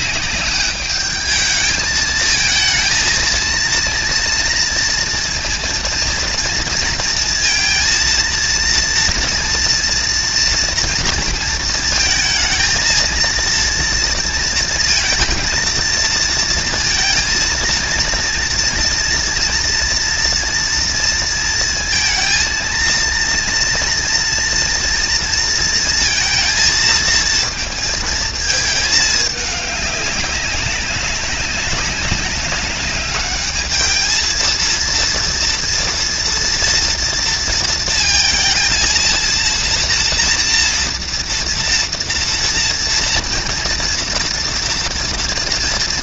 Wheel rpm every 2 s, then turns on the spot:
210, 230, 230, 230, 230, 230, 230, 230, 230, 230, 230, 230, 230, 230, 220, 200, 200, 230, 230, 230, 230, 230, 230.
none